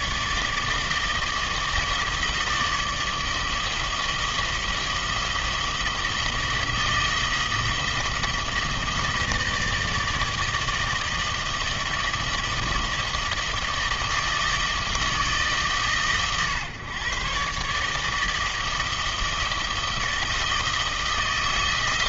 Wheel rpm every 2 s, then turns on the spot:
150, 160, 160, 160, 160, 160, 160, 160, 130, 160, 160.
none